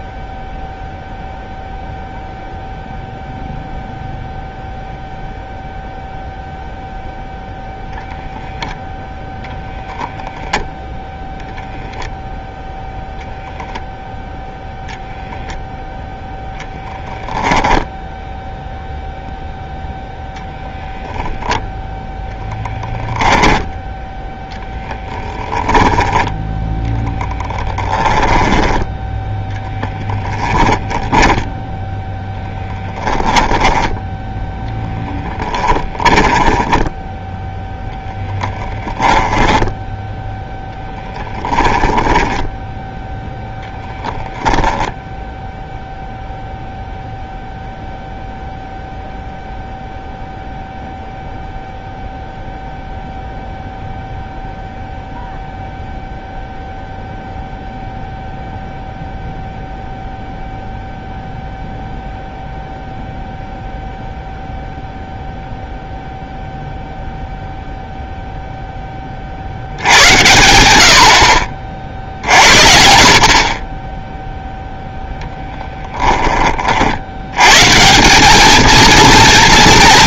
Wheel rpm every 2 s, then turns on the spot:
0, 0, 0, 0, 0, 0, 0, 0, 0, 0, 0, 0, 10, 0, 10, 10, 10, 0, 10, 10, 10, 10, 0, 0, 0, 0, 0, 0, 0, 0, 0, 0, 0, 0, 10, 80, 50, 0, 50, 230.
24-26 30-34 36-40